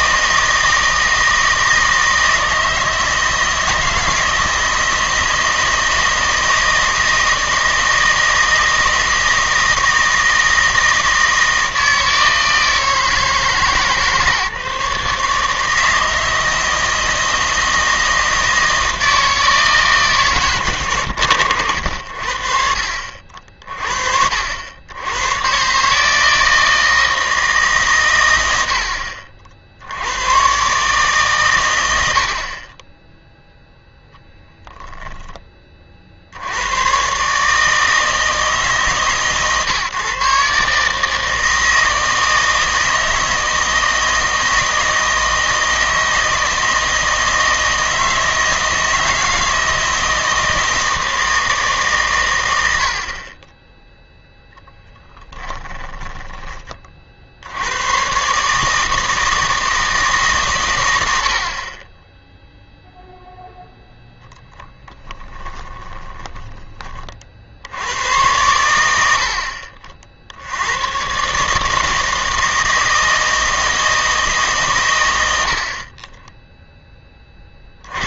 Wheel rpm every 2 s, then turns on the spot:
160, 160, 160, 160, 160, 160, 160, 150, 160, 160, 130, 60, 70, 160, 80, 130, 30, 0, 100, 150, 140, 160, 160, 160, 160, 160, 90, 0, 30, 150, 120, 0, 10, 20, 100, 90, 160, 130, 10.
64-66